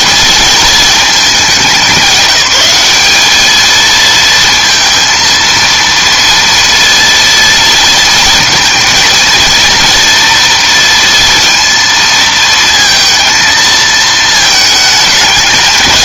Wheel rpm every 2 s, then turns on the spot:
220, 200, 230, 230, 230, 230, 230, 220.
none